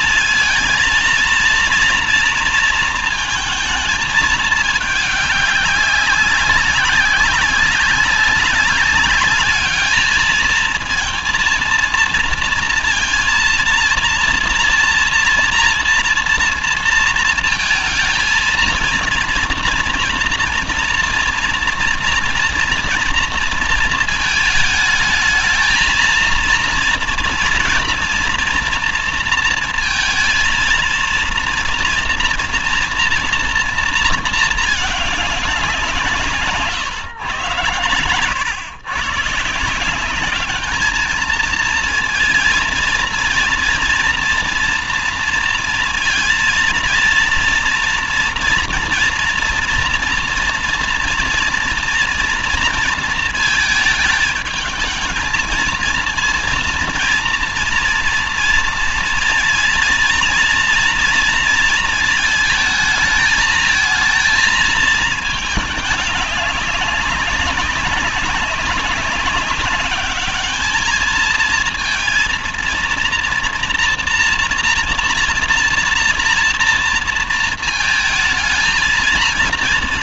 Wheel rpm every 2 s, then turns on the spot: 220, 230, 210, 190, 200, 230, 230, 230, 230, 230, 230, 230, 220, 230, 230, 230, 230, 210, 140, 110, 210, 230, 240, 230, 240, 230, 230, 220, 230, 230, 230, 220, 220, 200, 190, 210, 230, 230, 230, 220.
none